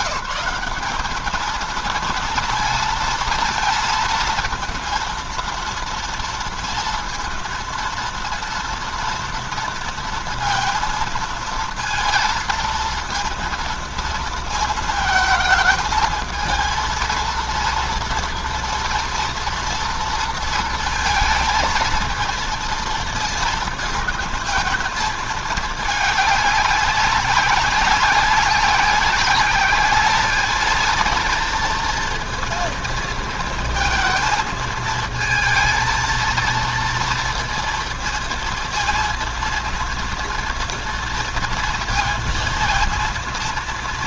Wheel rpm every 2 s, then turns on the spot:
210, 230, 230, 230, 230, 230, 230, 230, 220, 230, 230, 230, 220, 210, 190, 220, 230, 220, 230, 230, 230, 230.
none